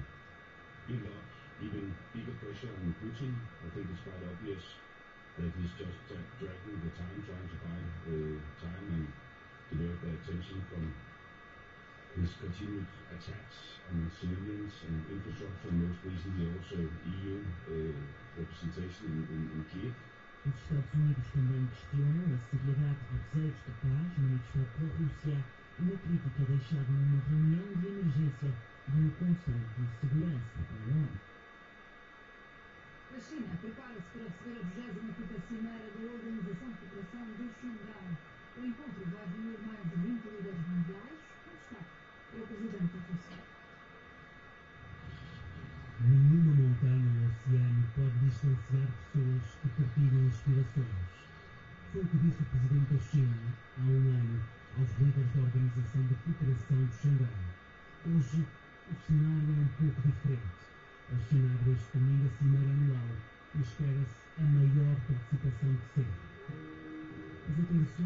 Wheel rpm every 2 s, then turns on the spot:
0, 0, 0, 0, 0, 0, 0, 0, 0, 0, 0, 0, 0, 0, 0, 0, 0, 0, 0, 0, 0, 0, 0, 0, 0, 0, 0, 0, 0, 0, 0, 0, 0, 0.
none